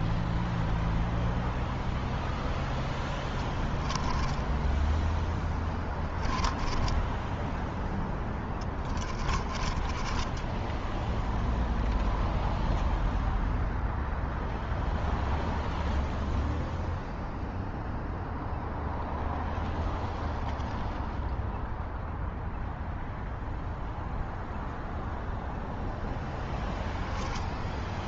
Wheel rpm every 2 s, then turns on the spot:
0, 20, 10, 10, 30, 0, 0, 0, 0, 0, 0, 0, 0, 10.
2-10